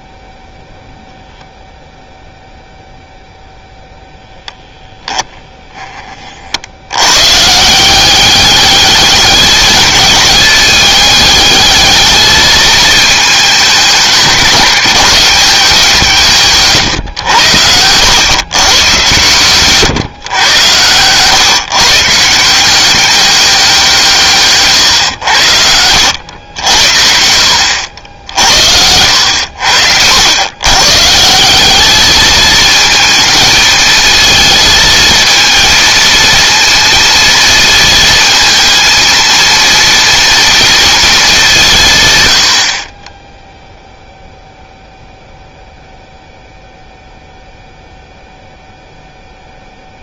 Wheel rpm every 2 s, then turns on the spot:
0, 0, 10, 130, 210, 210, 210, 190, 100, 120, 130, 190, 90, 70, 80, 160, 220, 230, 230, 230, 200, 10, 0, 0, 0.
28-30